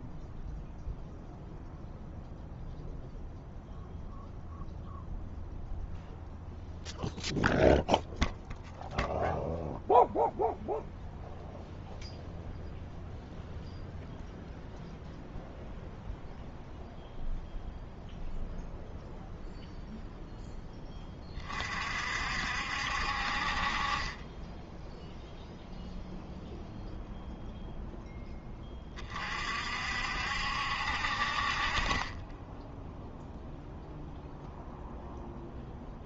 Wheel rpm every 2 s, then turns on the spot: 0, 0, 0, 0, 0, 0, 0, 0, 0, 0, 20, 60, 0, 0, 30, 60, 0, 0.
none